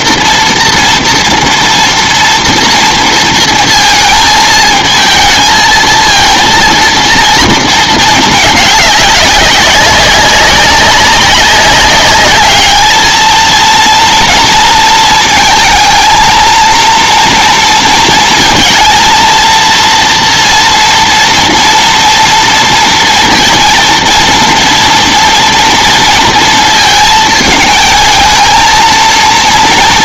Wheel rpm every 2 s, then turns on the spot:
230, 230, 220, 230, 210, 200, 210, 220, 230, 230, 230, 230, 230, 220, 230.
none